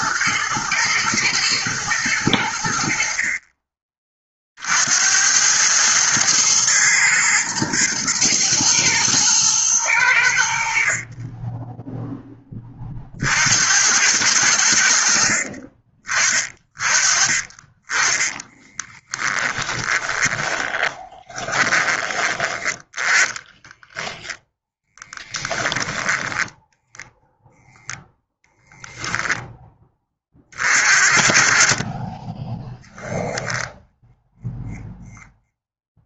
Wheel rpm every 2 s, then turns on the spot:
110, 60, 80, 120, 110, 50, 40, 60, 30, 10, 10, 20, 10, 0, 0, 50, 0, 0.
18-26